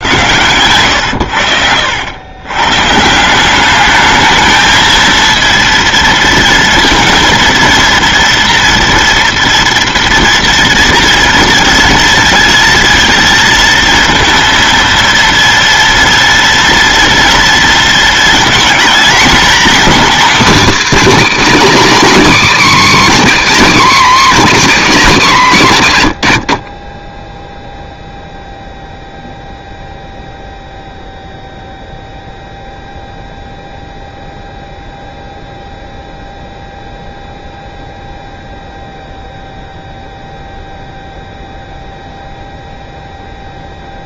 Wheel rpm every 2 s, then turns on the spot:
120, 120, 220, 230, 230, 230, 230, 230, 230, 220, 270, 230, 210, 60, 0, 0, 0, 0, 0, 0, 0, 0.
none